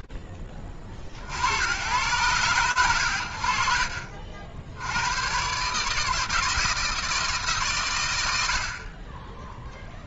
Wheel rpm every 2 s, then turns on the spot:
70, 70, 120, 160, 10.
none